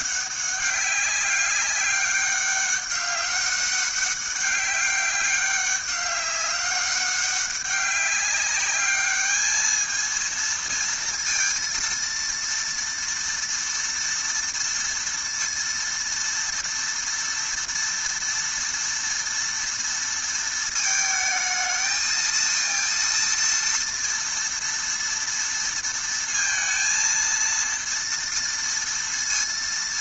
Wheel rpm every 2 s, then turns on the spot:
200, 200, 200, 200, 200, 230, 230, 230, 230, 240, 230, 230, 230, 230, 230.
none